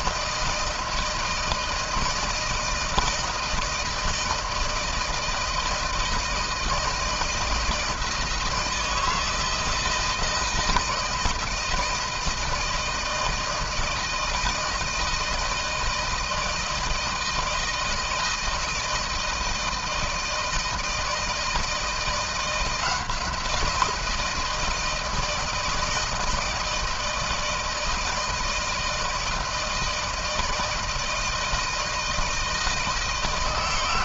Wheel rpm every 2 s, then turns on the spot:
160, 160, 160, 160, 160, 160, 160, 160, 160, 160, 160, 170, 170, 160, 160, 160, 160.
none